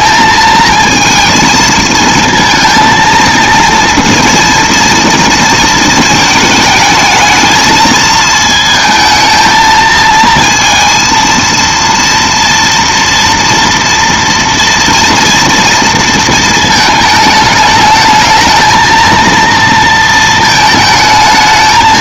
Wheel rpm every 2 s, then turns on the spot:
220, 230, 230, 220, 220, 230, 230, 230, 230, 220, 220.
none